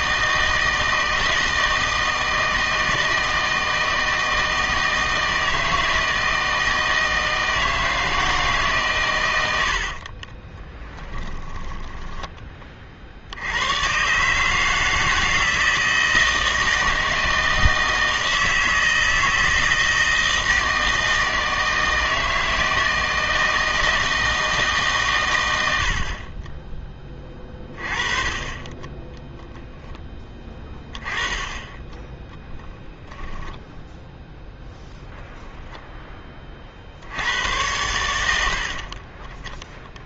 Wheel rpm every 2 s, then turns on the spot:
160, 160, 160, 160, 140, 10, 30, 160, 160, 160, 160, 160, 160, 20, 20, 20, 10, 10, 40, 70.
10-12 32-34